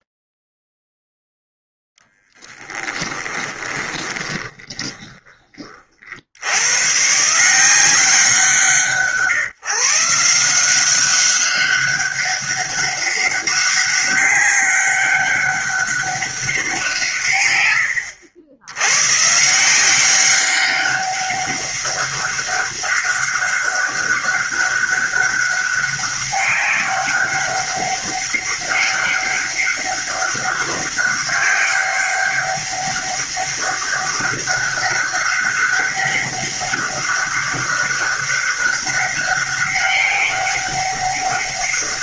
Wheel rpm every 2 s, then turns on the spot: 0, 10, 20, 80, 170, 170, 200, 200, 190, 90, 200, 200, 200, 190, 200, 200, 200, 200, 200, 200, 200.
2-6